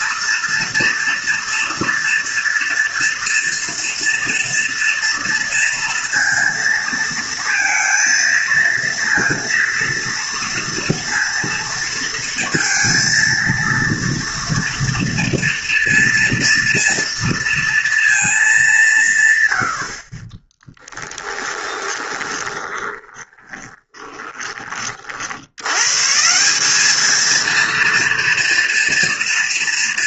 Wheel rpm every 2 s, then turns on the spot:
230, 230, 230, 230, 230, 230, 230, 230, 230, 190, 10, 30, 40, 200, 230.
20-24